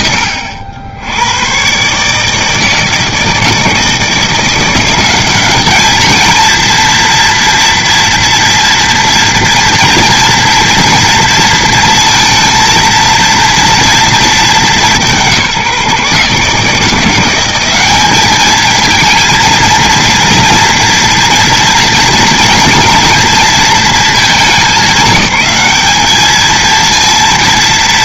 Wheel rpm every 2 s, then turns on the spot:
90, 160, 190, 230, 230, 230, 230, 160, 170, 230, 230, 230, 200, 230.
none